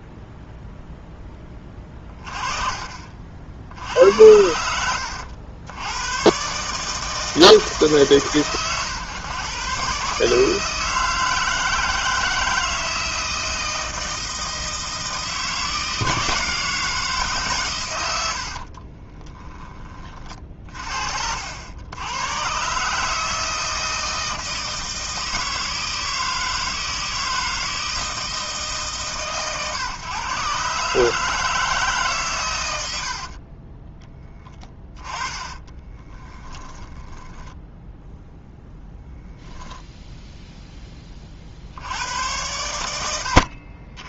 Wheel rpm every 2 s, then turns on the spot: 0, 30, 80, 150, 120, 160, 160, 160, 160, 40, 50, 140, 160, 160, 140, 150, 70, 20, 10, 0, 20, 100.
18-20 34-38